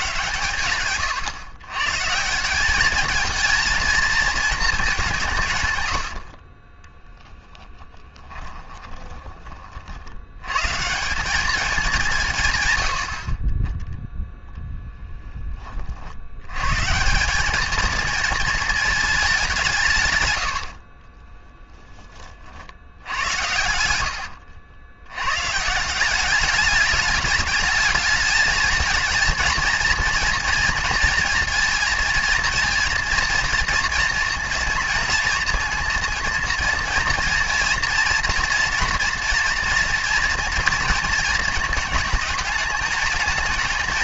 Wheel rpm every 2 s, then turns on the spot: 120, 200, 210, 20, 30, 140, 90, 0, 140, 220, 60, 70, 90, 210, 220, 230, 230, 230, 230, 230, 230, 220.
6-10 20-22